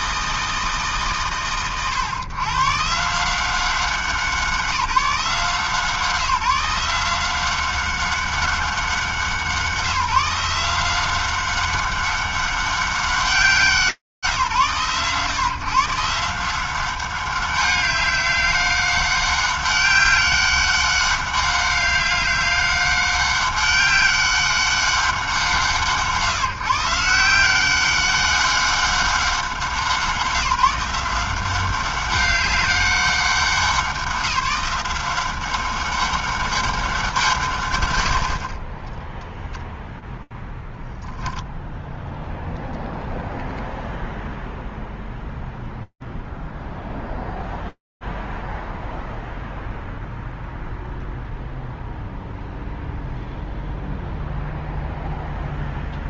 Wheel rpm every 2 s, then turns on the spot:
160, 140, 180, 160, 190, 170, 190, 140, 180, 190, 200, 200, 200, 140, 200, 170, 190, 180, 190, 70, 0, 0, 0, 0, 0, 0, 0, 0.
none